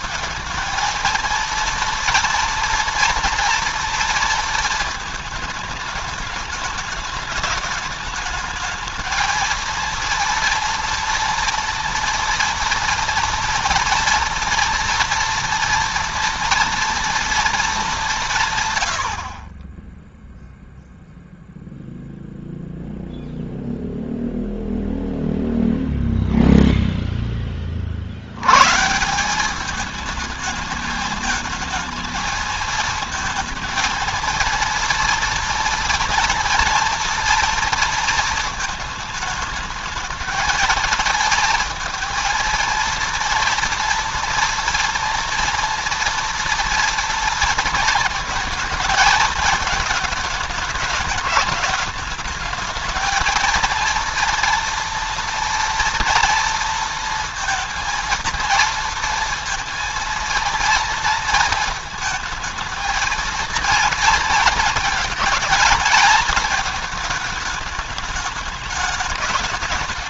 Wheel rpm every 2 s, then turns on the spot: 220, 230, 230, 210, 220, 230, 230, 230, 240, 150, 0, 0, 0, 0, 120, 210, 220, 230, 230, 220, 220, 230, 230, 230, 220, 210, 220, 230, 230, 230, 230, 220, 230, 220, 210.
none